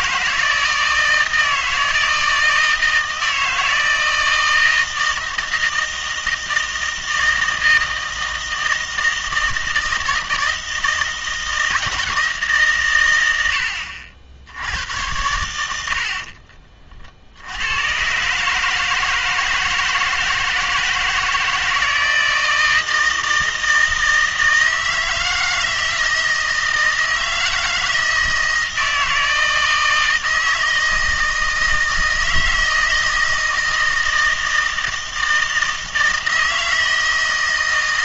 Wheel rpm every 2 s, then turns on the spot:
160, 160, 160, 160, 160, 160, 130, 90, 40, 150, 160, 160, 160, 160, 160, 160, 160, 160, 160.
none